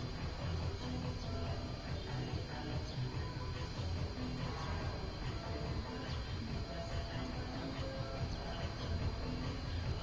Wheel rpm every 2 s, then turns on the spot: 0, 0, 0, 0, 0.
none